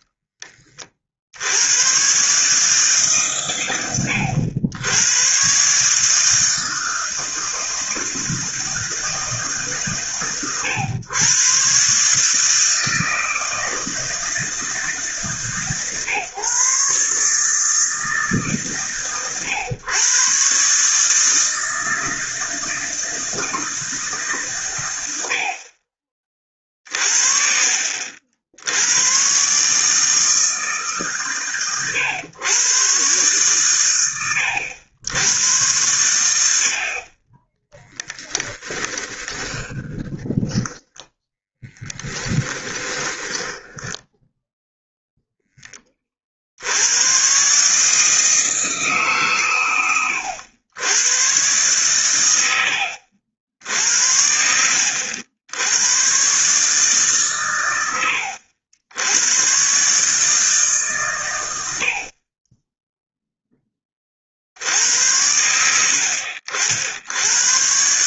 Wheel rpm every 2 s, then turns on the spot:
40, 140, 100, 160, 160, 120, 160, 150, 140, 140, 150, 160, 100, 40, 90, 140, 130, 90, 50, 10, 10, 10, 0, 90, 150, 110, 80, 80, 150, 80, 130, 0, 80, 70.
38-44